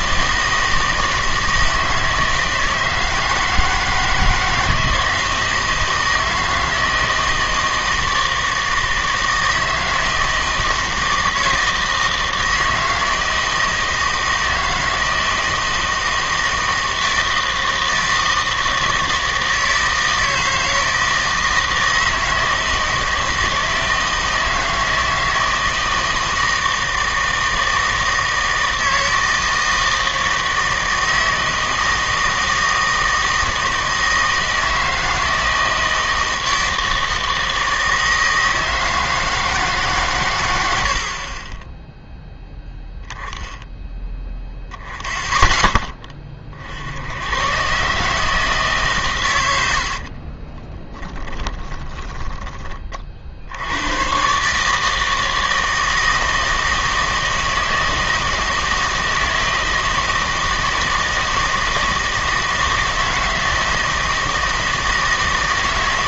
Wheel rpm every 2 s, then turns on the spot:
160, 160, 160, 160, 160, 160, 160, 160, 160, 160, 160, 160, 160, 160, 160, 160, 160, 160, 160, 160, 80, 10, 10, 60, 150, 20, 30, 150, 160, 160, 160, 160, 160.
50-52